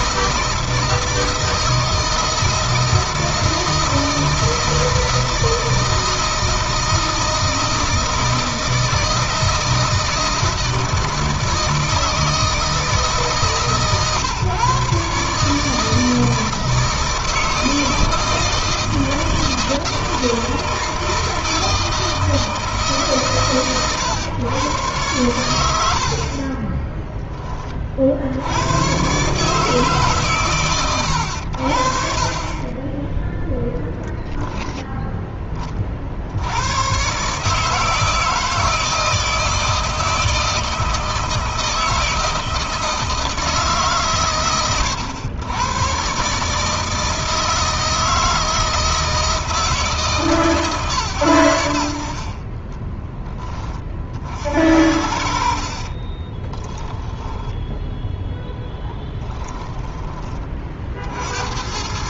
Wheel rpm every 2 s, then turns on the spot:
160, 160, 160, 160, 160, 160, 160, 140, 160, 160, 160, 150, 110, 20, 110, 110, 20, 10, 120, 160, 160, 160, 100, 160, 160, 140, 20, 60, 10, 10, 50.
26-28 52-54 56-60